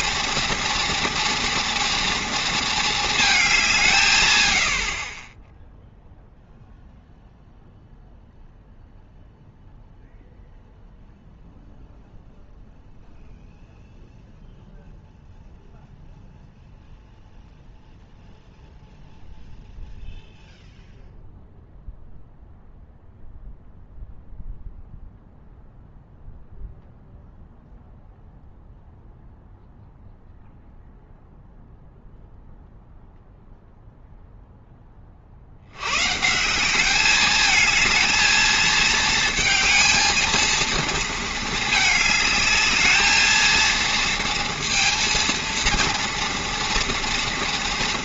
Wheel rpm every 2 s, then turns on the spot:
230, 230, 80, 0, 0, 0, 0, 0, 0, 0, 0, 0, 0, 0, 0, 0, 0, 10, 180, 220, 230, 210, 230, 240.
none